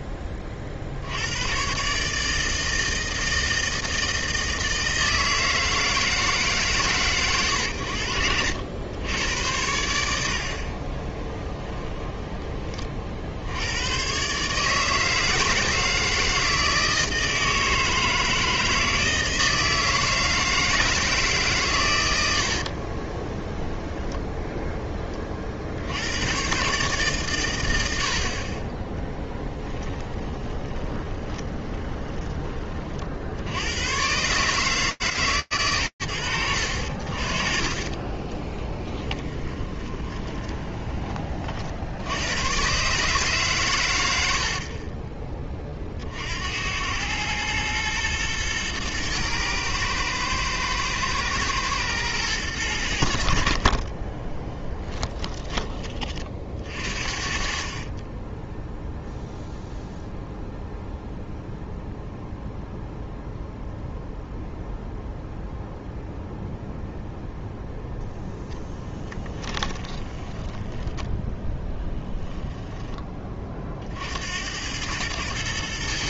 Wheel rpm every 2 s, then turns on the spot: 50, 160, 160, 120, 80, 30, 40, 160, 160, 160, 160, 40, 10, 140, 20, 20, 20, 120, 50, 10, 30, 140, 30, 110, 110, 110, 60, 20, 40, 0, 0, 0, 0, 0, 10, 10, 30, 110.
22-24 30-32 38-40 54-56 68-70